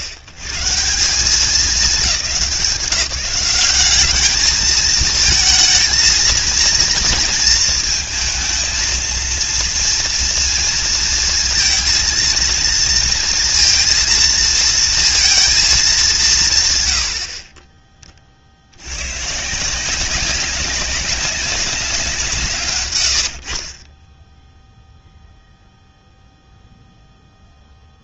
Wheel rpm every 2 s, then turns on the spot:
100, 180, 220, 230, 230, 230, 230, 230, 130, 70, 190, 130, 0, 0.
none